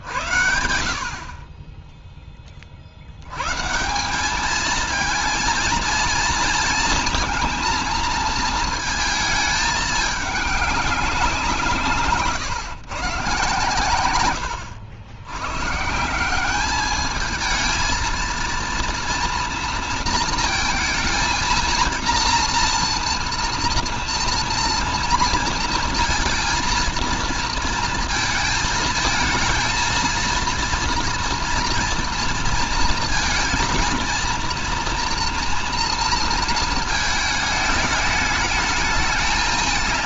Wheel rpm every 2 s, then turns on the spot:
50, 40, 210, 230, 220, 200, 140, 110, 200, 230, 230, 230, 230, 230, 220, 230, 230, 230, 230, 220.
none